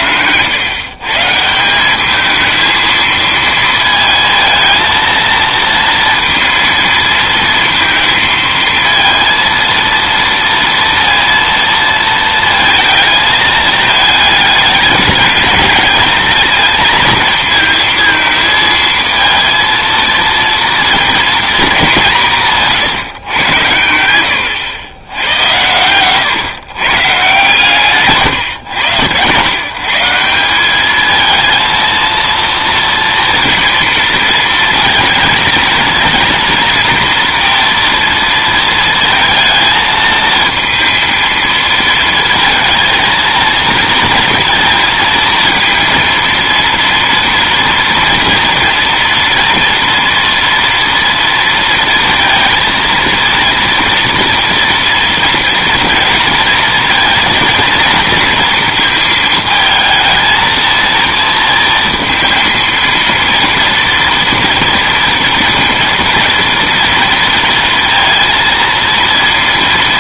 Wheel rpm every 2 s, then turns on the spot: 110, 220, 220, 230, 230, 230, 220, 210, 220, 220, 230, 150, 110, 130, 120, 190, 230, 230, 230, 230, 230, 230, 230, 230, 230, 230, 230, 230, 230, 230, 230, 230, 230, 230, 230.
none